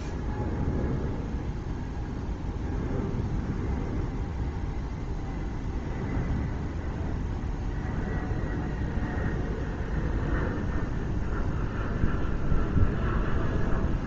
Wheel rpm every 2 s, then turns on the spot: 0, 0, 0, 0, 0, 0, 0.
none